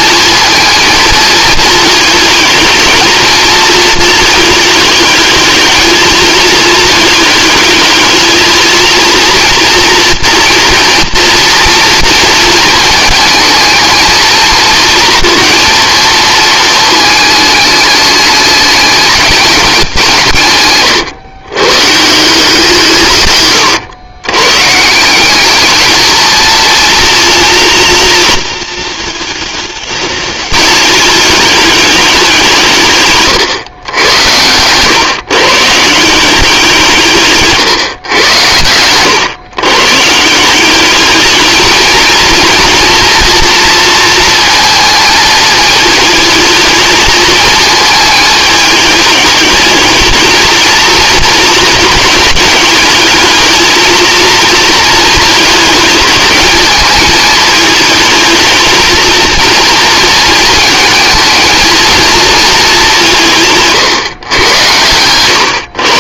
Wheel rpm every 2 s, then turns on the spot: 230, 230, 220, 220, 230, 230, 220, 230, 220, 210, 140, 150, 160, 230, 220, 210, 150, 120, 170, 110, 200, 230, 220, 220, 210, 220, 210, 220, 220, 220, 220, 200, 100.
none